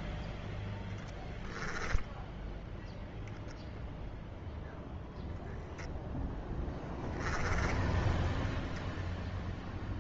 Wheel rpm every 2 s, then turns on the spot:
10, 0, 0, 0, 0.
none